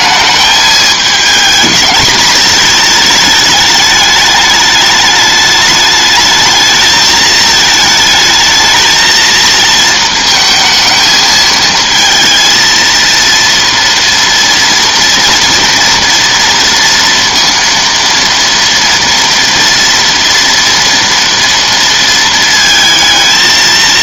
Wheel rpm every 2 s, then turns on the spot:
220, 220, 210, 220, 220, 220, 230, 230, 230, 230, 240, 220.
none